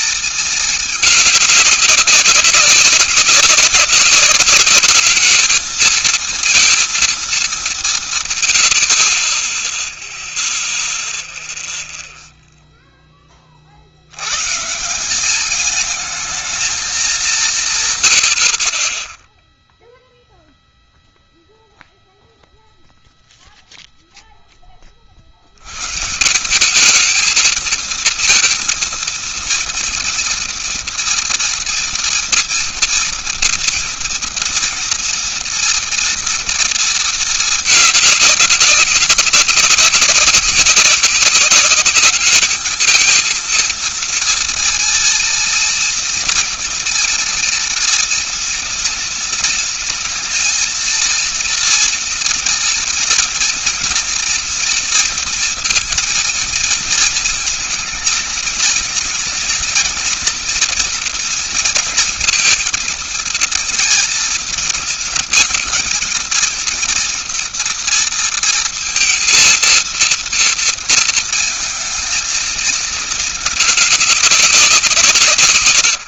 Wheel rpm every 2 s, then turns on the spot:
220, 190, 200, 230, 110, 0, 0, 120, 220, 60, 0, 0, 10, 180, 230, 230, 230, 230, 230, 200, 190, 210, 230, 230, 230, 230, 230, 230, 230, 230, 230, 230, 230, 230, 230, 230, 220, 190.
none